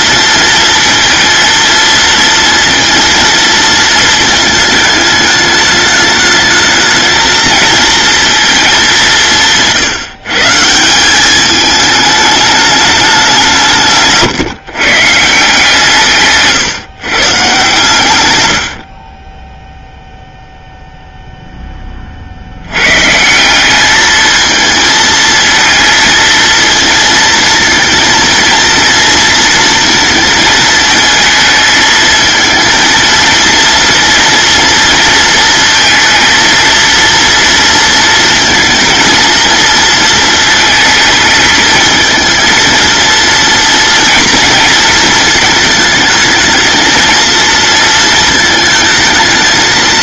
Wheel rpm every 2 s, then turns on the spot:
230, 230, 210, 220, 200, 170, 210, 150, 130, 60, 0, 110, 220, 220, 230, 220, 220, 230, 230, 230, 220, 230, 220, 220, 220.
none